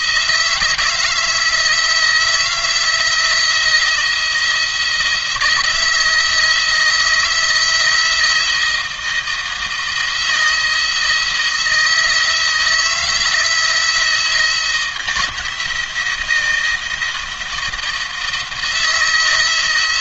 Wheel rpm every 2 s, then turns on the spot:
160, 170, 170, 160, 160, 160, 160, 170, 170, 160.
none